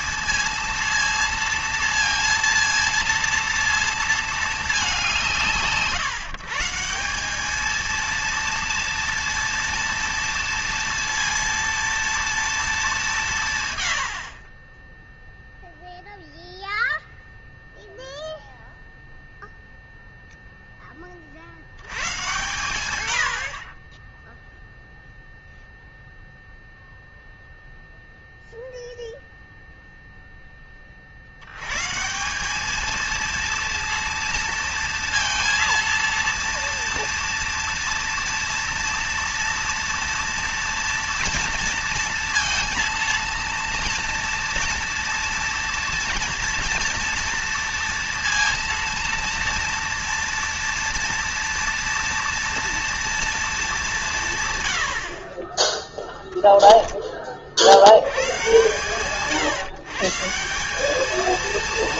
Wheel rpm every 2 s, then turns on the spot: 230, 230, 200, 170, 230, 230, 210, 20, 0, 0, 10, 100, 0, 0, 0, 30, 210, 230, 230, 230, 230, 230, 230, 230, 230, 230, 230, 80, 10, 130, 200.
none